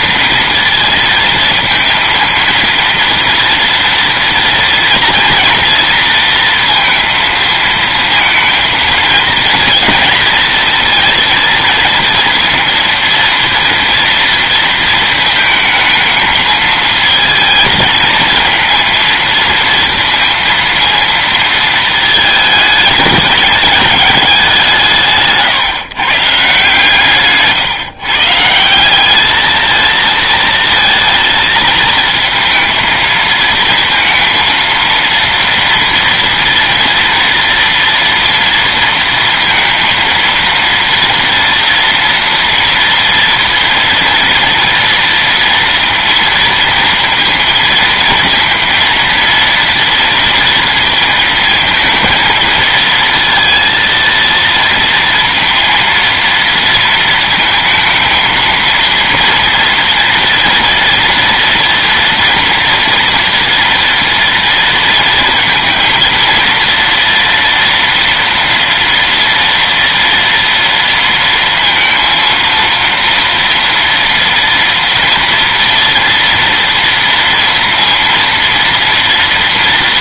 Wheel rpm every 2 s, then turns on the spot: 230, 230, 230, 230, 220, 230, 230, 230, 220, 230, 230, 210, 170, 150, 170, 230, 230, 230, 230, 230, 230, 230, 230, 230, 230, 230, 230, 230, 230, 230, 230, 230, 230, 230, 230, 230, 230, 230, 230, 230.
none